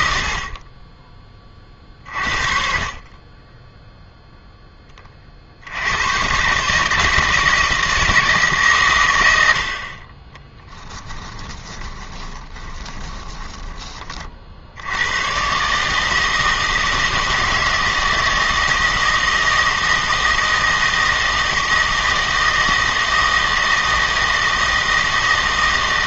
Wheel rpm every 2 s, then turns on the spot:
40, 40, 20, 150, 130, 10, 20, 80, 160, 160, 160, 160, 160.
10-14